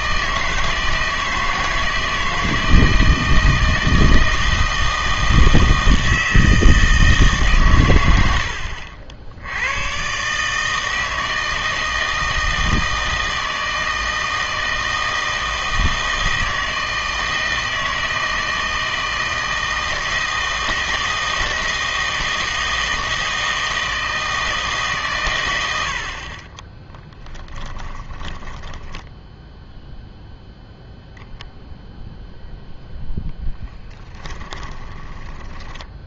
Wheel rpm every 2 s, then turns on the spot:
160, 160, 160, 160, 80, 150, 160, 160, 160, 160, 160, 160, 160, 30, 10, 0, 0, 20.
26-30 34-36